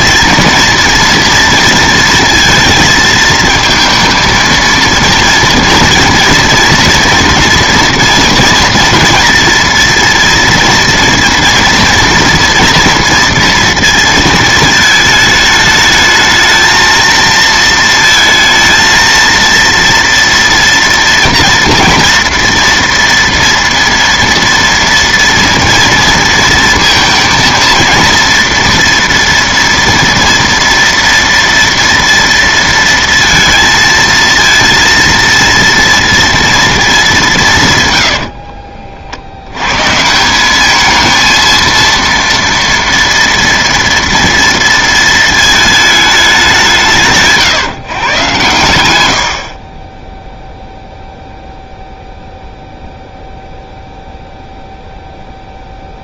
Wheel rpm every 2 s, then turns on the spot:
230, 230, 230, 230, 230, 230, 230, 220, 220, 230, 240, 230, 230, 230, 240, 240, 230, 230, 230, 60, 210, 230, 230, 180, 110, 0, 0, 0.
38-40